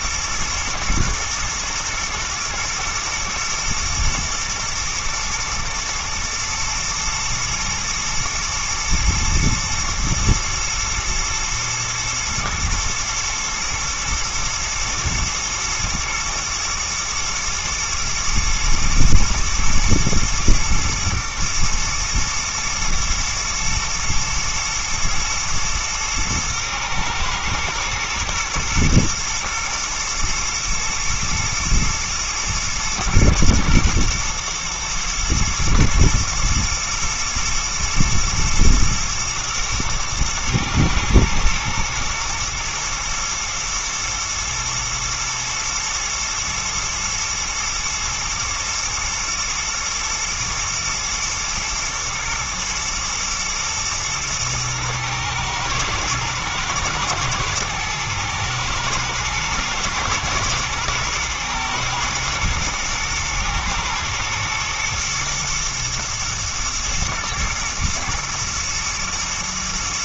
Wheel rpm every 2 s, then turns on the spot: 110, 110, 110, 110, 120, 110, 120, 120, 110, 110, 110, 120, 120, 120, 110, 120, 110, 110, 110, 120, 110, 120, 110, 110, 110, 110, 120, 110, 110, 110, 110, 120, 120, 110, 120.
none